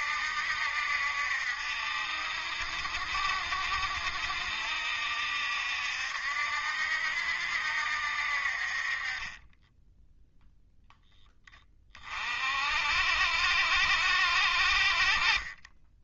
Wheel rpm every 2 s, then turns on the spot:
70, 70, 70, 70, 40, 0, 50, 50.
none